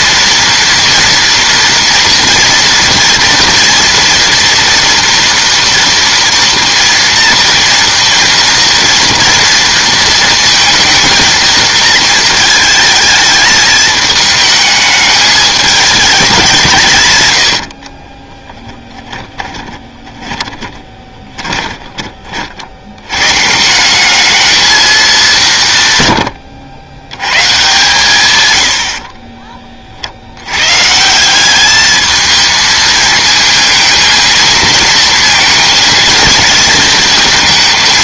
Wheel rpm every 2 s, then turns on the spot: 240, 230, 230, 230, 230, 230, 220, 210, 180, 10, 20, 50, 220, 90, 100, 110, 220, 220, 230.
18-22